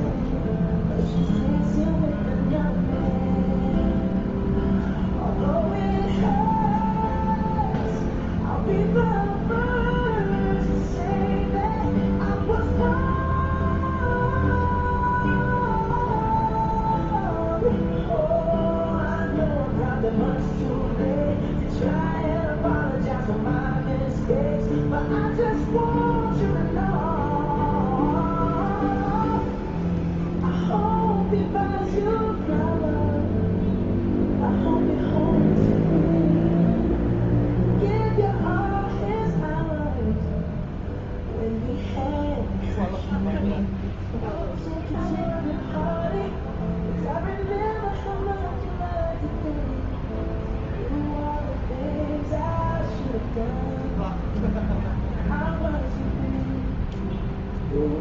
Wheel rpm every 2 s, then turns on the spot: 0, 0, 0, 0, 0, 0, 0, 0, 0, 0, 0, 0, 0, 0, 0, 0, 0, 0, 0, 0, 0, 0, 0, 0, 0, 0, 0, 0, 0.
none